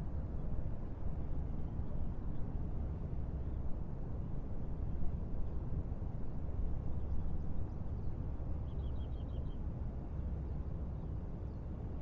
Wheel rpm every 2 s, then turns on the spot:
0, 0, 0, 0, 0, 0.
none